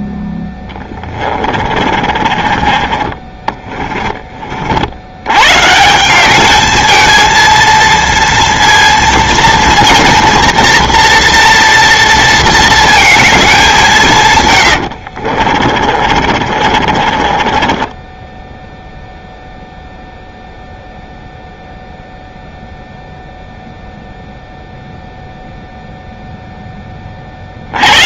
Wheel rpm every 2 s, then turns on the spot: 10, 30, 70, 220, 230, 230, 230, 80, 40, 0, 0, 0, 0, 10.
0-2 14-18